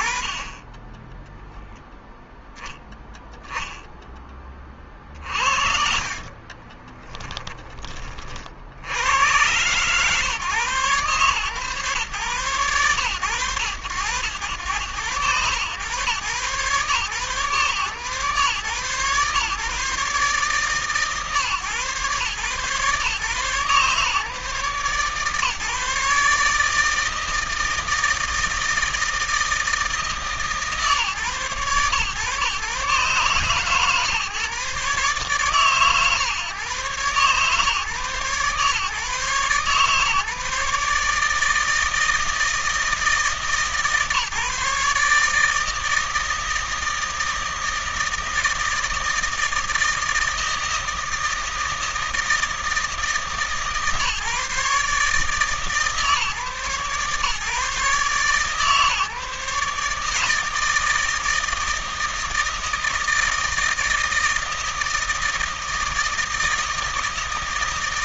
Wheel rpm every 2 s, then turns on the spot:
10, 0, 40, 30, 80, 120, 110, 100, 130, 120, 140, 140, 140, 160, 160, 130, 130, 140, 130, 140, 150, 160, 150, 160, 160, 160, 160, 150, 130, 150, 160, 160, 160, 160.
6-8